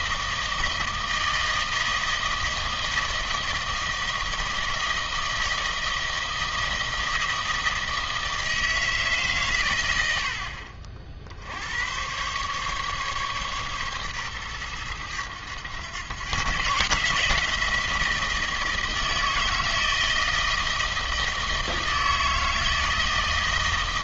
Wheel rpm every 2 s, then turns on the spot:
160, 160, 160, 160, 150, 60, 140, 110, 150, 160, 160, 160.
none